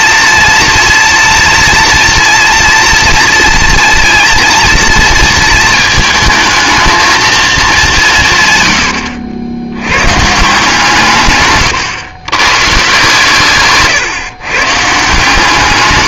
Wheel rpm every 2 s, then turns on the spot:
230, 230, 230, 220, 110, 150, 130, 140.
none